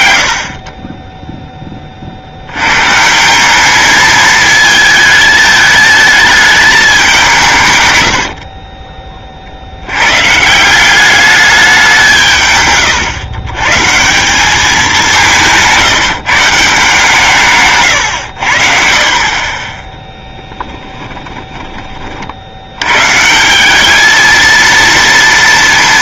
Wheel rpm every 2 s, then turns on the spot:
20, 140, 220, 200, 30, 190, 120, 190, 150, 40, 10, 110, 230.
12-14 20-22